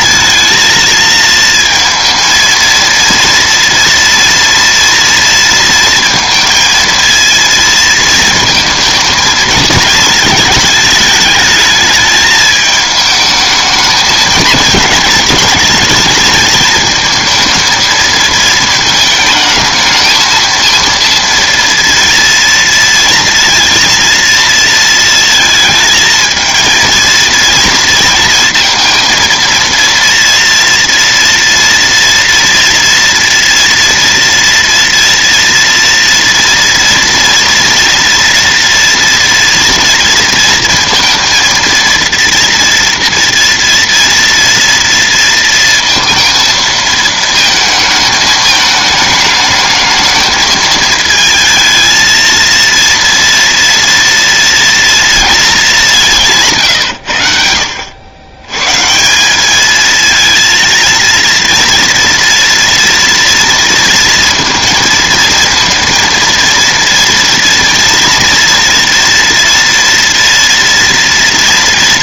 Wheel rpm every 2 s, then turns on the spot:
220, 230, 230, 230, 220, 220, 220, 230, 220, 220, 230, 230, 220, 230, 230, 230, 230, 230, 230, 230, 230, 230, 230, 220, 210, 220, 230, 230, 90, 170, 230, 230, 230, 230, 230, 230.
none